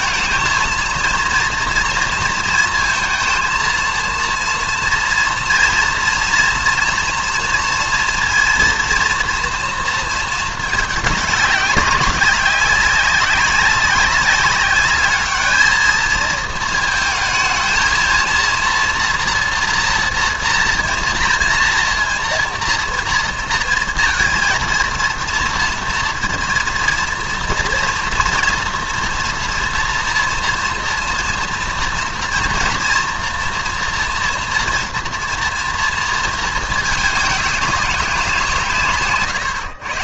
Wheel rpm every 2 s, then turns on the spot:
230, 230, 230, 230, 240, 210, 190, 200, 220, 240, 230, 230, 230, 230, 240, 230, 230, 230, 220, 150.
none